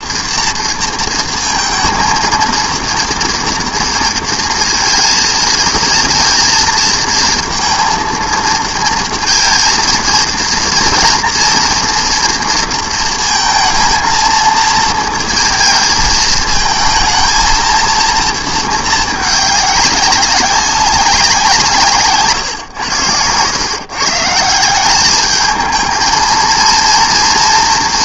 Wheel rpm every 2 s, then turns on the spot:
230, 230, 220, 230, 230, 230, 230, 230, 220, 220, 190, 110, 190, 230.
none